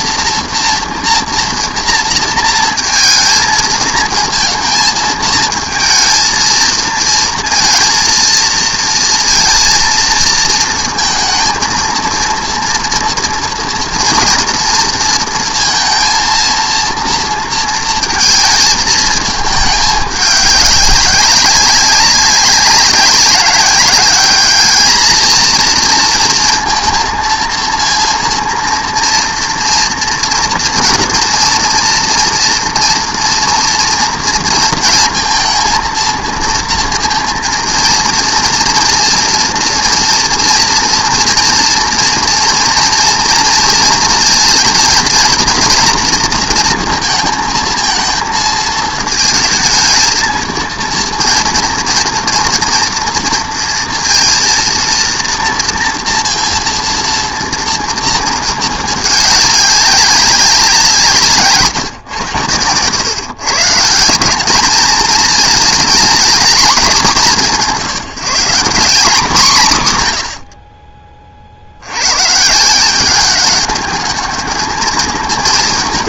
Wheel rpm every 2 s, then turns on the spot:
230, 230, 220, 230, 230, 230, 230, 230, 230, 220, 190, 190, 220, 230, 230, 230, 230, 230, 230, 240, 230, 230, 230, 220, 220, 230, 230, 230, 230, 210, 140, 140, 220, 180, 210, 30, 190, 220.
none